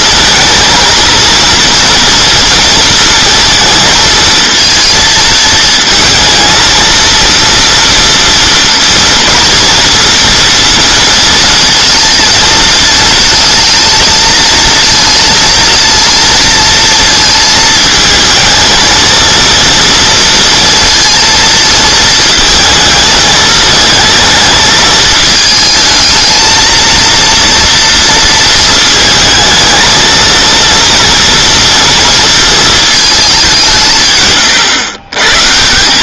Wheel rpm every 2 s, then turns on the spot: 230, 230, 230, 220, 230, 230, 220, 220, 230, 220, 230, 220, 220, 220, 220, 230, 230, 130.
none